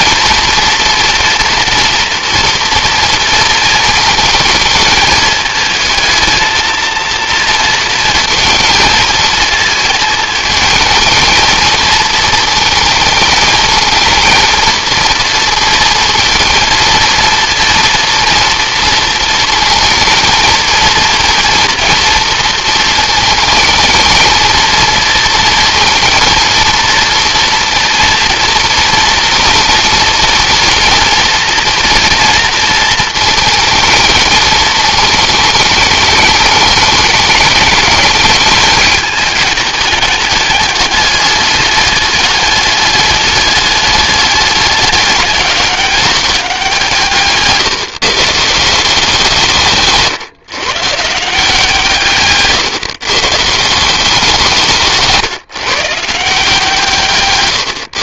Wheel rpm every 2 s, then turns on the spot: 230, 230, 220, 230, 230, 220, 220, 220, 230, 230, 220, 220, 230, 230, 230, 230, 230, 220, 210, 210, 210, 210, 200, 170, 170, 140, 140, 170, 160.
none